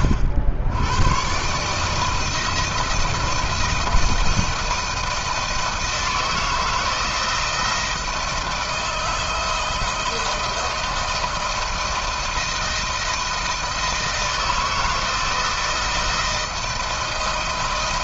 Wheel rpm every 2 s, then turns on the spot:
80, 160, 160, 160, 160, 170, 170, 160, 170.
none